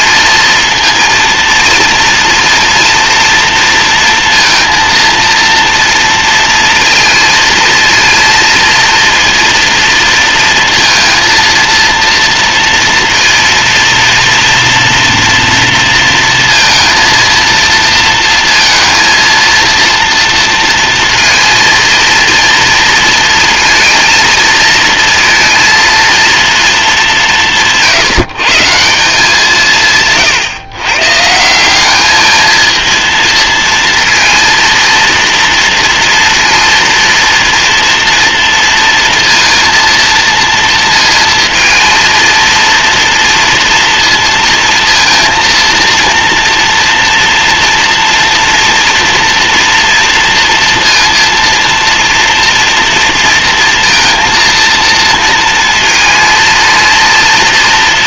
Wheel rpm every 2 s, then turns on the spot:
230, 230, 230, 230, 230, 230, 230, 230, 230, 230, 230, 230, 230, 210, 160, 130, 220, 230, 230, 230, 230, 230, 230, 230, 230, 230, 230, 230, 230.
none